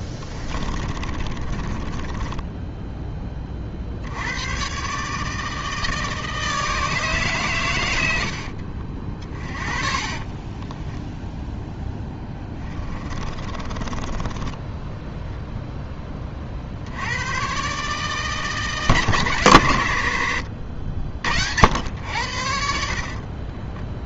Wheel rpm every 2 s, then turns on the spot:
20, 10, 130, 160, 60, 0, 30, 10, 60, 150, 70, 60.
0-2 8-10 12-16